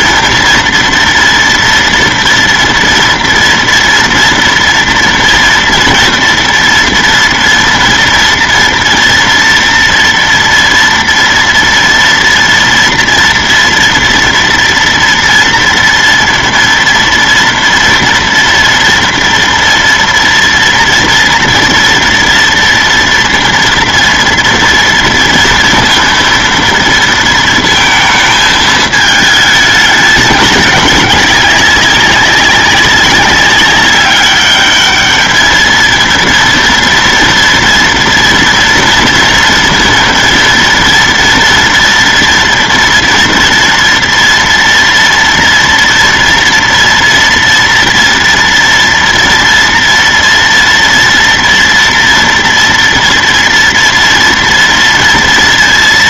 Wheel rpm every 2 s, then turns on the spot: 230, 230, 230, 230, 230, 230, 230, 230, 230, 230, 230, 230, 230, 230, 220, 200, 200, 210, 230, 230, 230, 230, 230, 230, 230, 230, 230, 230.
none